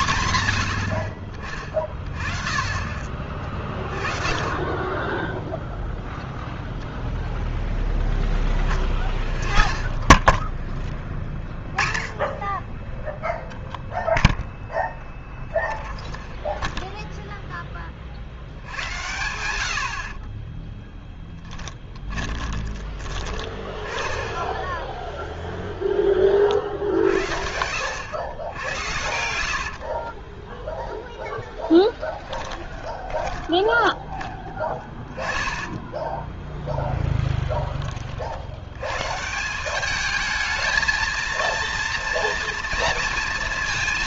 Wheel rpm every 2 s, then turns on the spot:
80, 30, 30, 0, 0, 10, 20, 0, 0, 100, 20, 20, 10, 50, 100, 10, 10, 20, 10, 60, 220, 230.
20-22 30-34